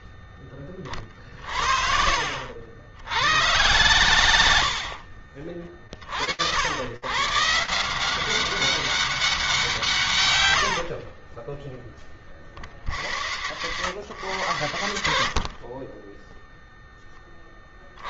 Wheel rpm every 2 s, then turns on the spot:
20, 90, 60, 120, 190, 40, 110, 50, 30.
0-2